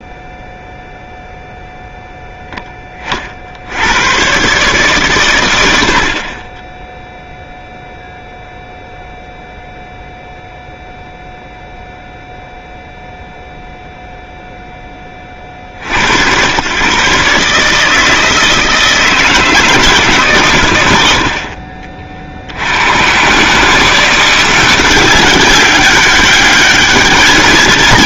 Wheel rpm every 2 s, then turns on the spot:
0, 20, 140, 10, 0, 0, 0, 0, 120, 160, 100, 90, 180, 200.
none